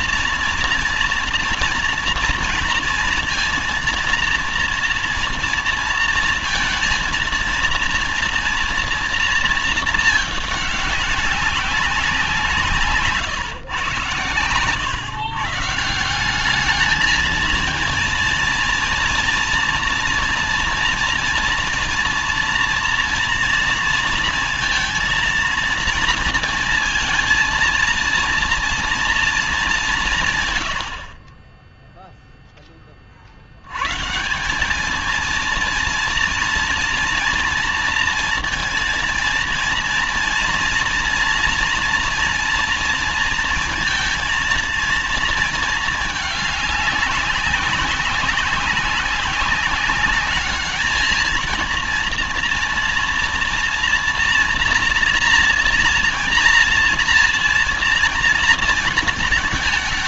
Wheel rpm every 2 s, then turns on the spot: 230, 230, 230, 230, 230, 210, 160, 130, 200, 230, 230, 230, 230, 230, 230, 110, 10, 200, 230, 230, 240, 230, 230, 210, 190, 220, 230, 230, 230, 230.
none